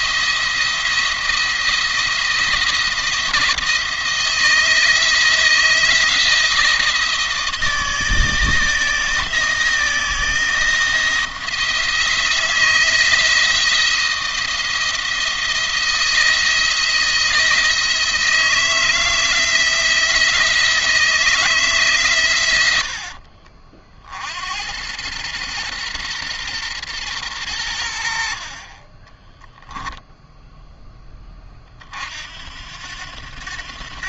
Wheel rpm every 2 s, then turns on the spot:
170, 170, 160, 160, 160, 160, 160, 160, 160, 160, 160, 90, 90, 120, 40, 0, 70.
none